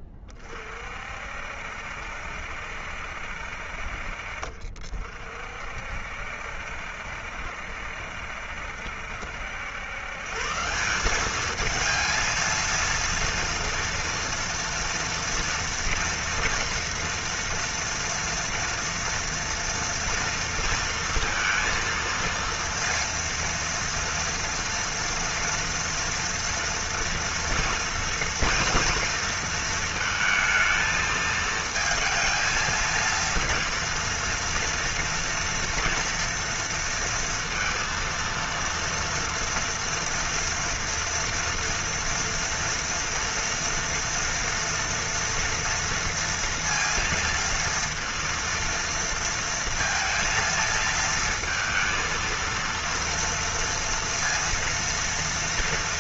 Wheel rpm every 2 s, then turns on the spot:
30, 70, 40, 60, 70, 150, 230, 230, 240, 230, 230, 230, 230, 230, 230, 220, 220, 230, 230, 230, 230, 230, 240, 230, 230, 230, 230, 230.
none